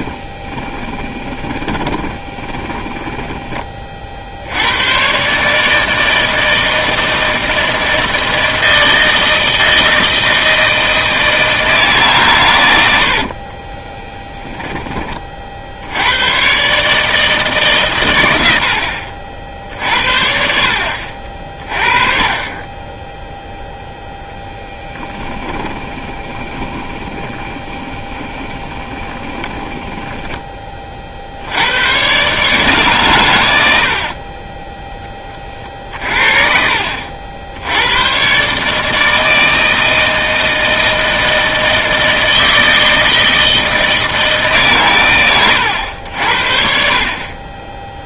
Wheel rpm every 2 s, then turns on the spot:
20, 10, 110, 160, 160, 160, 100, 20, 140, 80, 60, 10, 10, 20, 20, 30, 140, 10, 60, 150, 160, 160, 120, 50.
0-4 24-30